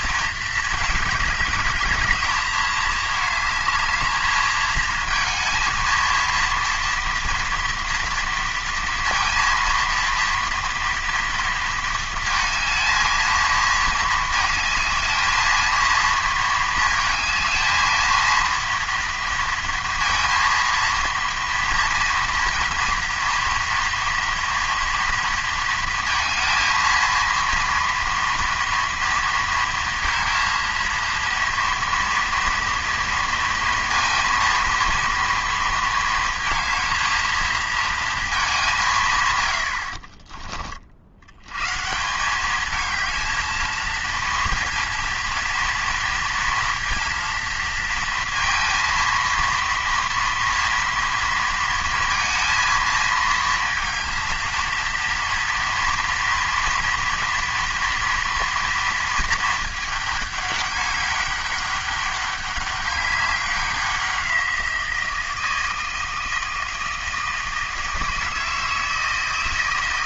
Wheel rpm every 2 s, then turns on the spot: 220, 220, 220, 230, 230, 230, 220, 220, 220, 230, 230, 230, 230, 230, 230, 230, 230, 230, 220, 200, 40, 210, 230, 230, 230, 230, 230, 230, 240, 230, 200, 200, 170, 160, 160.
none